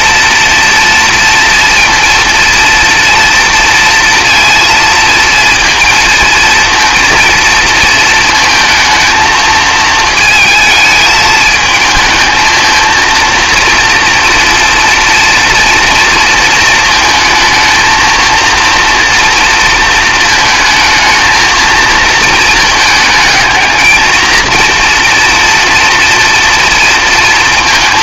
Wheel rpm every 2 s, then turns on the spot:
230, 230, 230, 230, 220, 220, 220, 230, 220, 230, 230, 220, 230, 230.
none